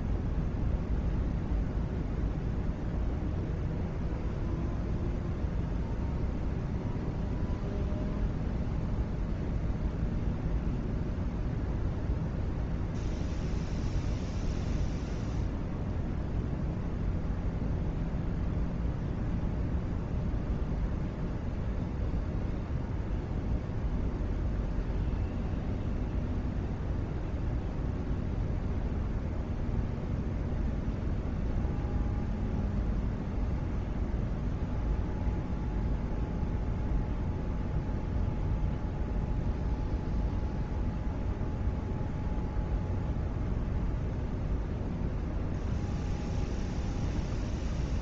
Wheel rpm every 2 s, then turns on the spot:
0, 0, 0, 0, 0, 0, 0, 0, 0, 0, 0, 0, 0, 0, 0, 0, 0, 0, 0, 0, 0, 0, 0, 0.
none